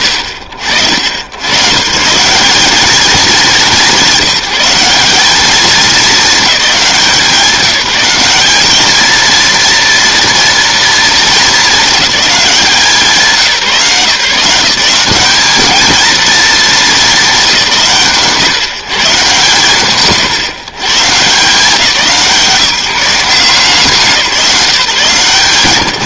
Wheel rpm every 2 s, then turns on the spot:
70, 200, 190, 210, 210, 230, 190, 180, 230, 150, 150, 170, 170.
none